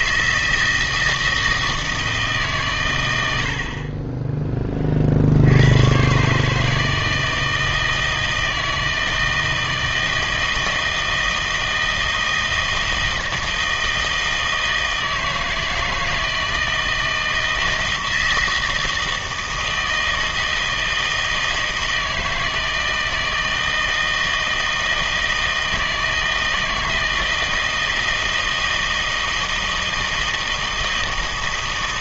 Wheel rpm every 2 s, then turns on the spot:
160, 130, 30, 150, 160, 160, 160, 160, 160, 160, 160, 160, 160, 160, 160, 160.
none